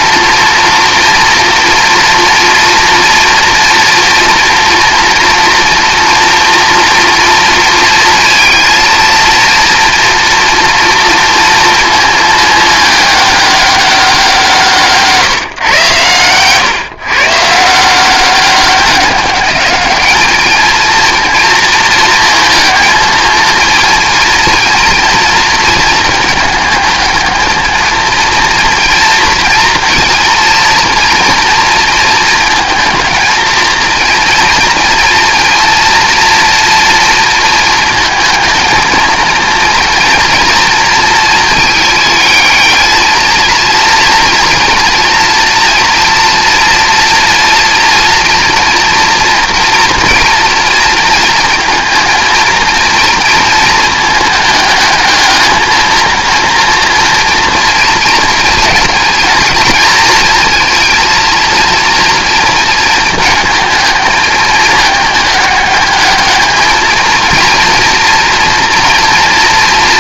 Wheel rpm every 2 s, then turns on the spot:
230, 230, 230, 240, 230, 230, 210, 160, 130, 200, 230, 230, 230, 210, 230, 230, 220, 230, 230, 230, 230, 220, 230, 230, 230, 230, 230, 210, 230, 230, 230, 220, 210, 220, 230.
none